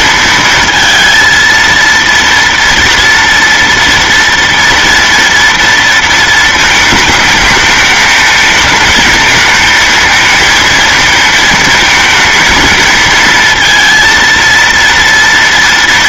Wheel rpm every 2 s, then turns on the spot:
220, 230, 230, 220, 220, 220, 230, 230.
none